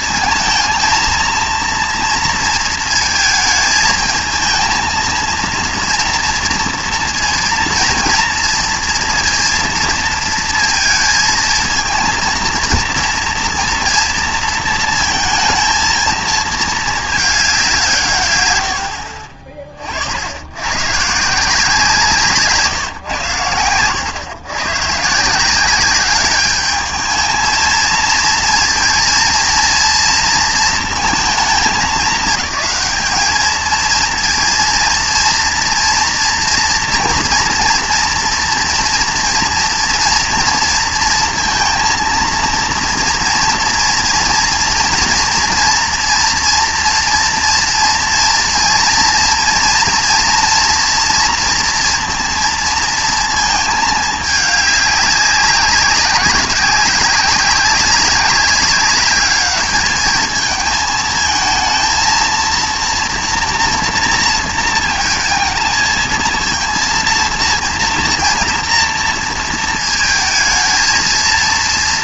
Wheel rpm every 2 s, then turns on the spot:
220, 230, 230, 230, 230, 230, 230, 230, 220, 90, 100, 150, 130, 210, 230, 230, 210, 230, 230, 230, 230, 230, 230, 230, 230, 230, 230, 200, 180, 200, 220, 230, 230, 230, 230, 220.
none